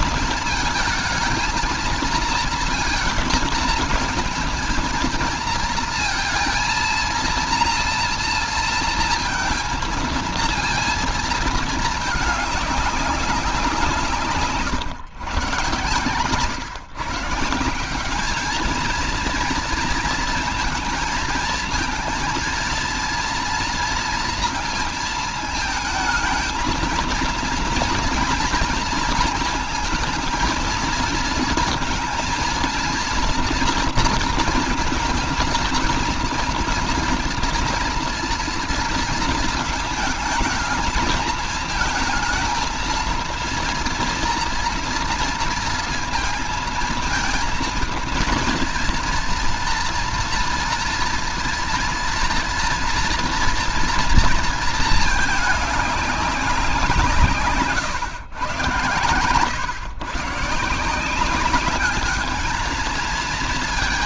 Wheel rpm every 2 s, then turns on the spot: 220, 230, 230, 230, 230, 230, 210, 150, 140, 220, 230, 230, 230, 230, 230, 230, 230, 230, 230, 230, 220, 230, 230, 230, 230, 230, 230, 220, 190, 110, 140, 220.
none